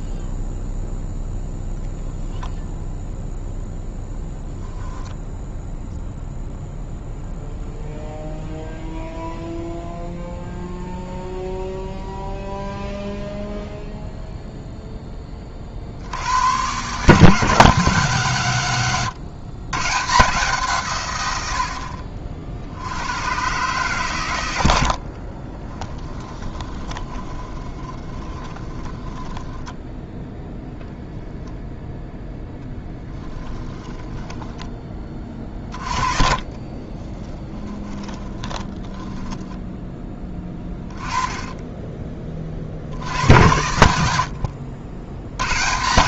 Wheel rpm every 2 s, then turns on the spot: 0, 0, 0, 0, 0, 0, 0, 0, 120, 140, 150, 70, 80, 20, 20, 0, 10, 20, 30, 10, 20, 60, 80.
26-30 32-34 36-40